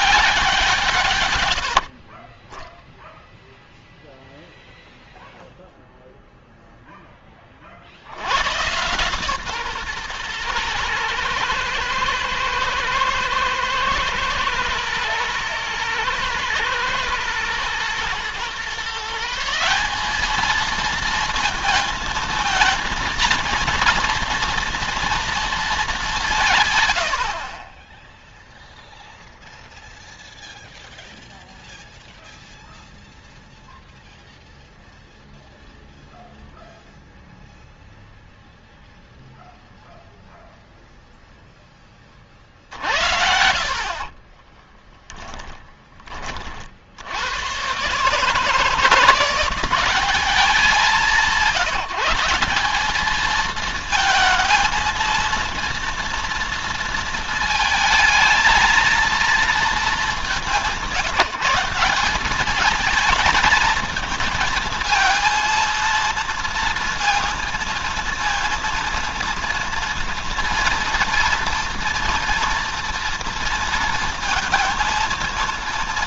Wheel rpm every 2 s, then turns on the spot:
140, 0, 0, 10, 130, 110, 120, 110, 110, 140, 230, 230, 240, 90, 0, 0, 0, 0, 0, 0, 0, 60, 10, 80, 170, 200, 210, 230, 230, 230, 180, 210, 220, 230, 230, 240, 230, 230.
42-46